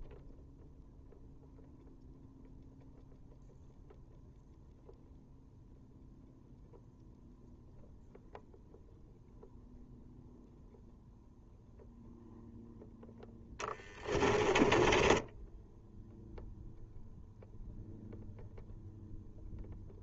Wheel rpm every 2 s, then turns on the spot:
0, 0, 0, 0, 0, 0, 10, 20, 0, 0.
14-16